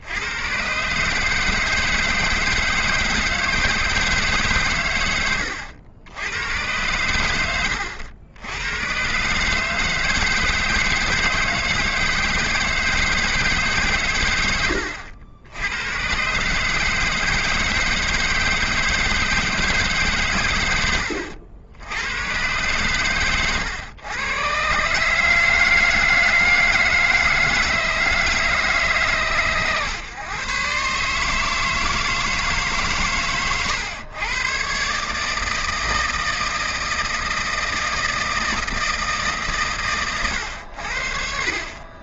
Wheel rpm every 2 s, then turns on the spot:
130, 160, 130, 100, 100, 150, 160, 100, 140, 170, 120, 120, 130, 160, 150, 130, 150, 130, 160, 160, 100.
none